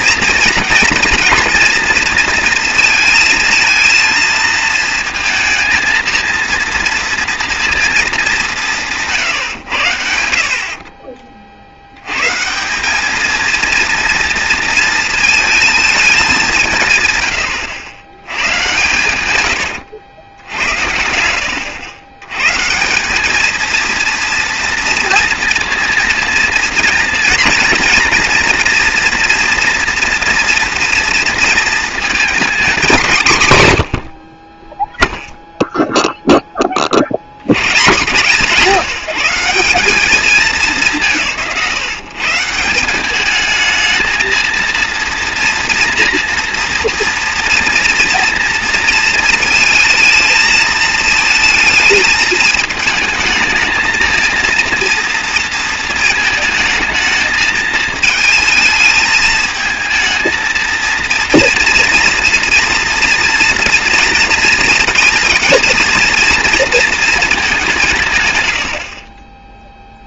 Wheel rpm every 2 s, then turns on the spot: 220, 230, 230, 230, 190, 50, 180, 230, 170, 120, 80, 140, 230, 230, 240, 230, 220, 30, 20, 160, 200, 170, 230, 230, 230, 220, 210, 230, 220, 220, 230, 230, 230, 230, 90.
68-70